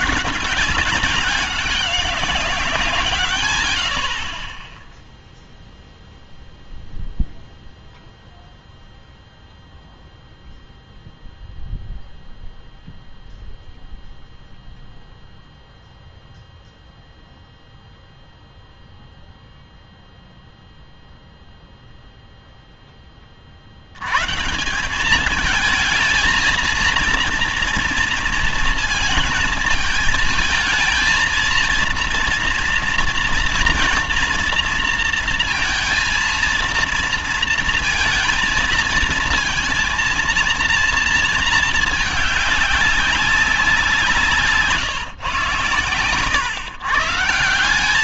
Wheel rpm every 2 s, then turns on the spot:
180, 180, 10, 0, 0, 0, 0, 0, 0, 0, 0, 10, 170, 230, 220, 220, 230, 230, 230, 230, 230, 200, 150, 130.
none